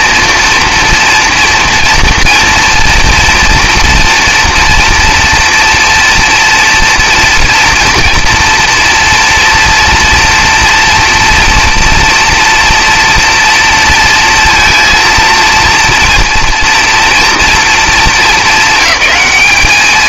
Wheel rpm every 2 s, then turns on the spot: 230, 230, 230, 230, 230, 230, 230, 230, 230, 220.
none